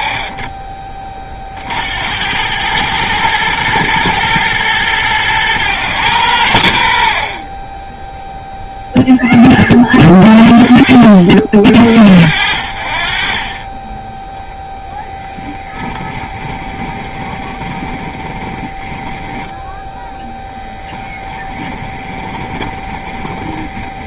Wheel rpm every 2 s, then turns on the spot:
30, 100, 110, 90, 0, 50, 50, 0, 20, 10, 20, 20.
16-24